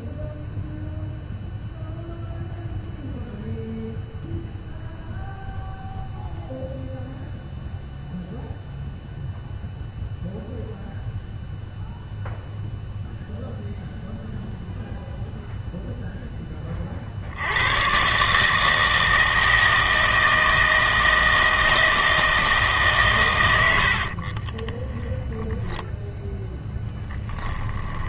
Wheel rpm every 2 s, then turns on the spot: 0, 0, 0, 0, 0, 0, 0, 0, 40, 160, 160, 150, 10, 10.
24-28